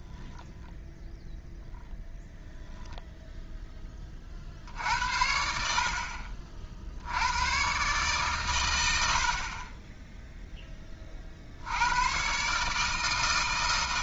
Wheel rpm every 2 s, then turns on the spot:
0, 0, 60, 60, 100, 10, 150.
none